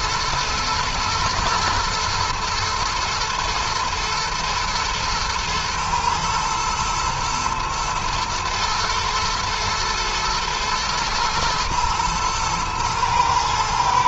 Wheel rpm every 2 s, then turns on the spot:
110, 110, 110, 120, 110, 110, 110.
none